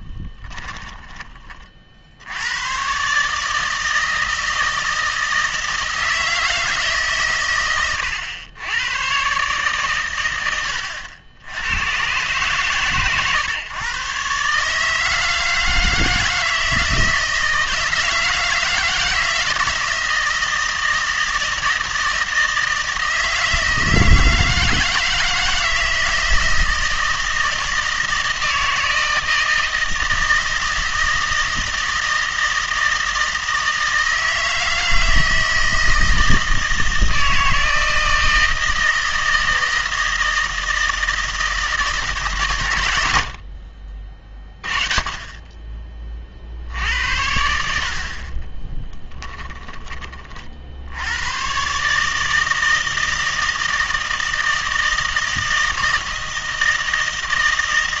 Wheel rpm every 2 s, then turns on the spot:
20, 110, 160, 160, 100, 90, 130, 150, 160, 160, 160, 160, 160, 160, 160, 160, 160, 160, 160, 160, 160, 110, 20, 60, 10, 60, 160, 160, 160.
0-2 48-50